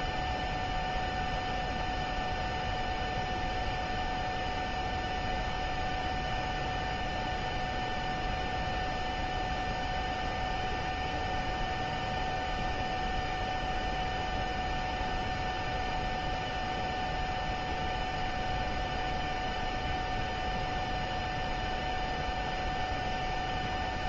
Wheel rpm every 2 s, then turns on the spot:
0, 0, 0, 0, 0, 0, 0, 0, 0, 0, 0, 0.
none